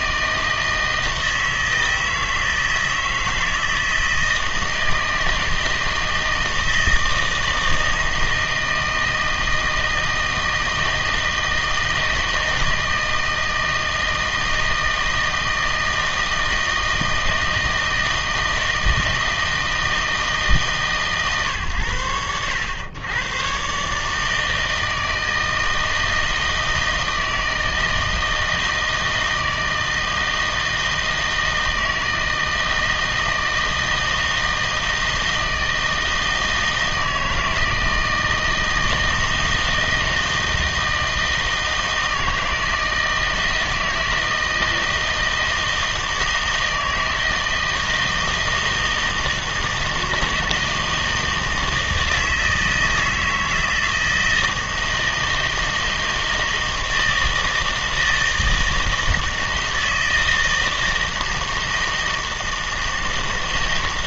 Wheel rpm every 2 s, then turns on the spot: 160, 160, 160, 160, 160, 160, 160, 160, 160, 160, 150, 100, 160, 160, 160, 160, 160, 160, 160, 160, 160, 160, 160, 160, 160, 160, 160, 160, 160, 160, 160, 160.
none